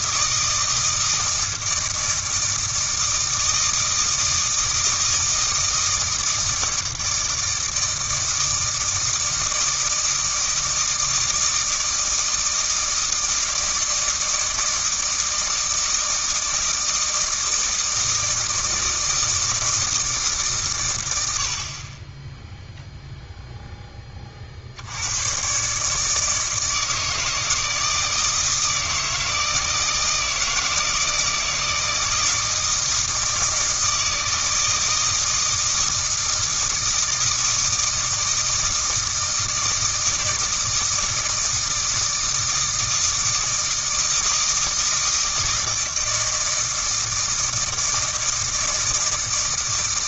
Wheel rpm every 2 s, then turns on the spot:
160, 160, 160, 160, 160, 160, 160, 160, 160, 160, 110, 0, 70, 160, 160, 160, 160, 160, 160, 160, 160, 160, 160, 160, 160.
none